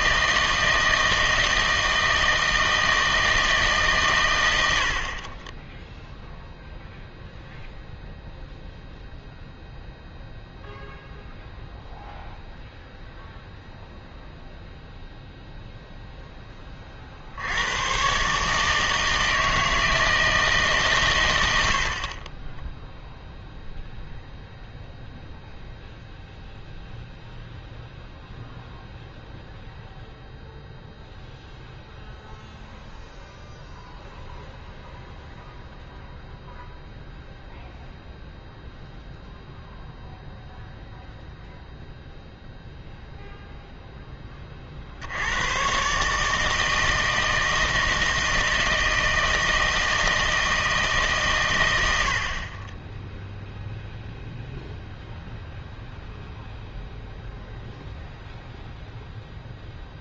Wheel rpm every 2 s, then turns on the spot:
160, 160, 80, 0, 0, 0, 0, 0, 20, 150, 140, 0, 0, 0, 0, 0, 0, 0, 0, 0, 0, 0, 50, 160, 160, 150, 20, 0, 0, 0.
none